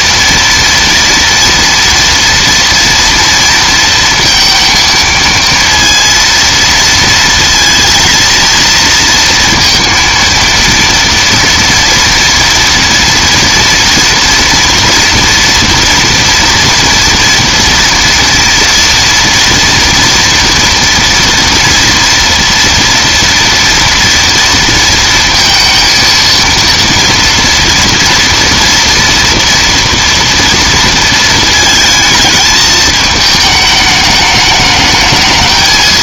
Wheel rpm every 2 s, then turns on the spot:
230, 230, 230, 230, 230, 230, 230, 230, 230, 240, 230, 230, 230, 230, 230, 230, 220, 210.
none